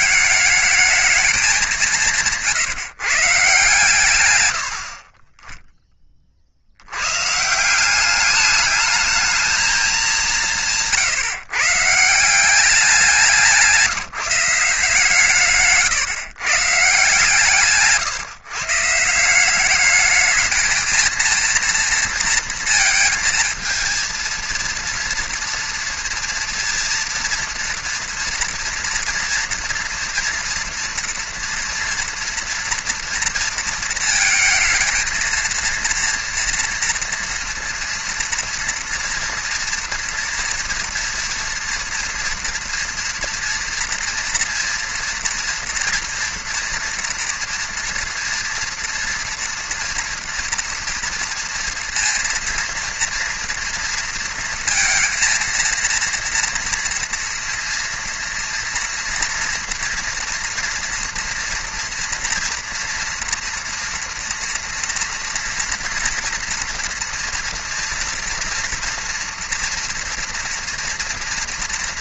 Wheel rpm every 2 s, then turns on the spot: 210, 170, 100, 50, 200, 180, 190, 160, 130, 140, 220, 230, 230, 230, 230, 230, 230, 220, 230, 240, 240, 230, 230, 230, 230, 230, 230, 230, 230, 230, 230, 230, 230, 230, 230, 230.
none